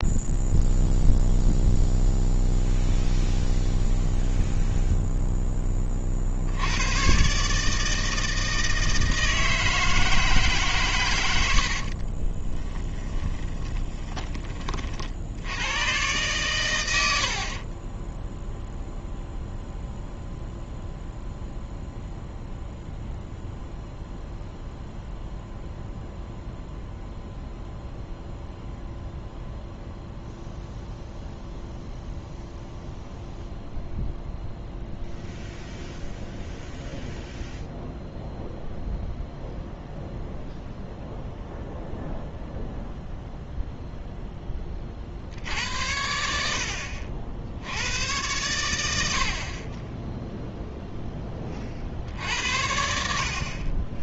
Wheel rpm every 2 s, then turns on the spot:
0, 0, 0, 110, 160, 130, 10, 50, 90, 0, 0, 0, 0, 0, 0, 0, 0, 0, 0, 0, 0, 0, 40, 70, 100, 0, 60.
12-14